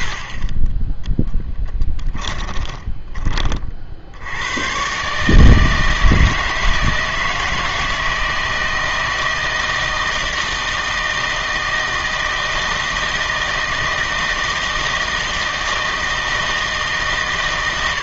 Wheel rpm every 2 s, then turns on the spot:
10, 20, 120, 160, 160, 160, 160, 160, 150.
2-4